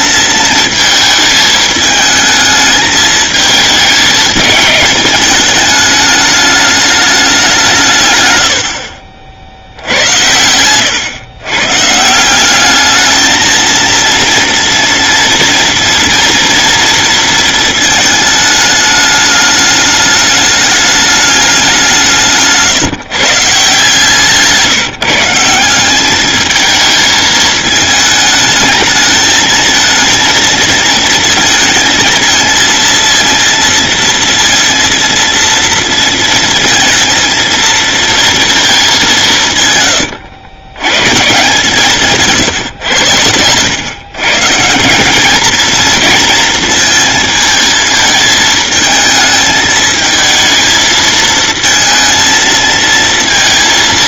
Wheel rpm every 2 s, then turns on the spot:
220, 220, 220, 210, 70, 100, 200, 230, 230, 210, 210, 140, 160, 210, 220, 220, 230, 230, 230, 220, 100, 150, 160, 230, 220, 220, 230.
8-12 42-44